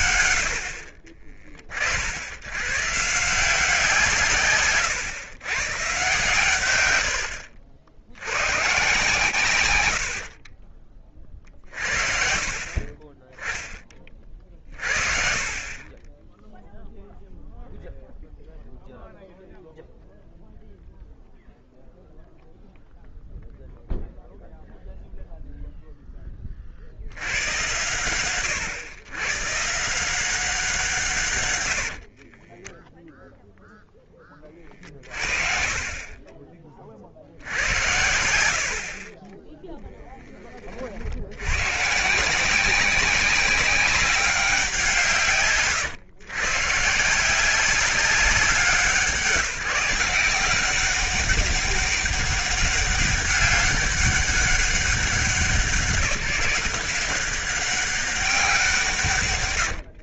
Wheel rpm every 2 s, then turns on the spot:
110, 90, 140, 110, 100, 40, 50, 40, 10, 0, 0, 0, 0, 40, 90, 180, 20, 30, 30, 60, 30, 180, 190, 120, 180, 180, 200, 200, 170, 180.
32-34